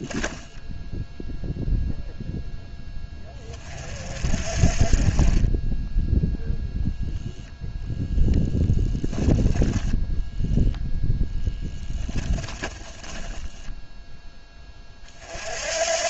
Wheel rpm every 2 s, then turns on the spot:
10, 10, 30, 0, 10, 0, 20, 40.
12-14